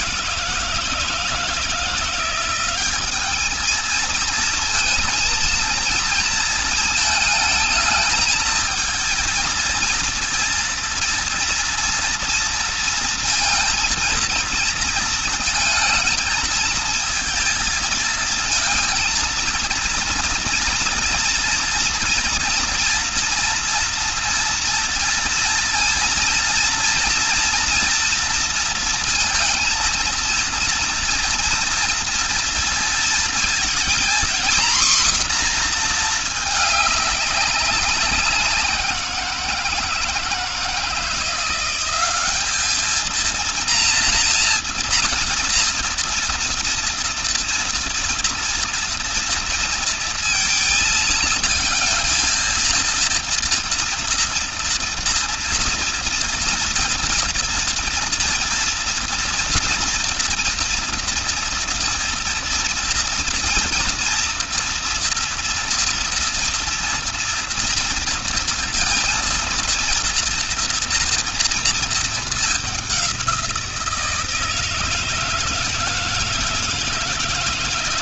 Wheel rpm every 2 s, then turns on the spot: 160, 180, 230, 220, 220, 230, 230, 230, 230, 230, 230, 230, 230, 230, 230, 230, 230, 240, 220, 180, 160, 210, 230, 230, 240, 230, 230, 230, 230, 230, 230, 230, 230, 230, 230, 230, 210, 160, 160.
none